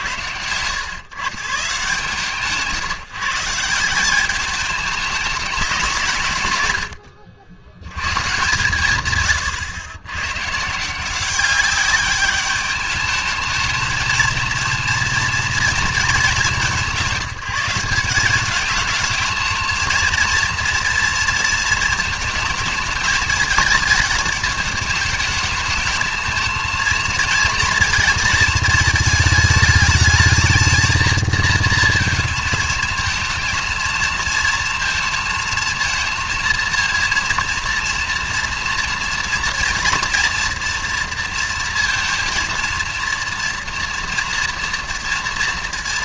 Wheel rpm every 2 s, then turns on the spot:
100, 160, 200, 100, 130, 150, 210, 230, 190, 210, 230, 220, 210, 220, 220, 220, 220, 230, 230, 230, 230, 230, 230.
none